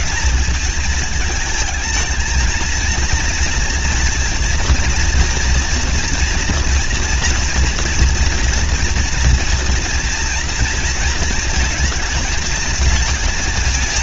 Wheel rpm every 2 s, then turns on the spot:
220, 220, 230, 240, 230, 230, 220.
none